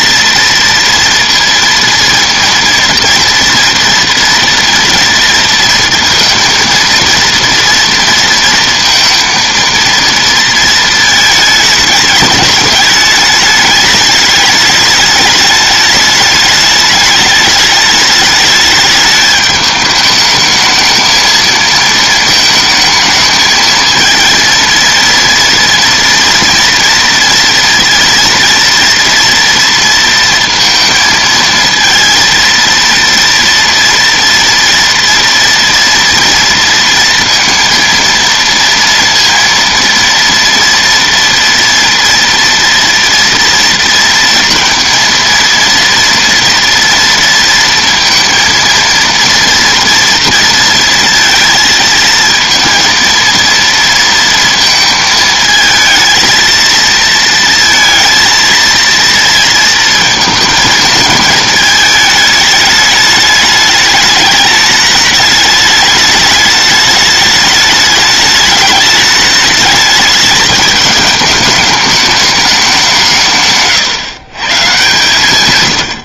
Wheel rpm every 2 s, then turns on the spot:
230, 230, 230, 230, 230, 220, 210, 210, 210, 210, 220, 220, 230, 230, 230, 230, 230, 230, 230, 230, 230, 230, 230, 230, 230, 230, 230, 220, 230, 230, 220, 210, 210, 210, 210, 210, 190, 130.
none